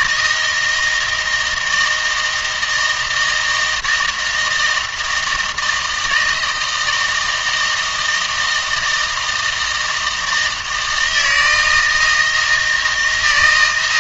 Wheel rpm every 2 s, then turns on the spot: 160, 160, 160, 160, 160, 160, 160.
none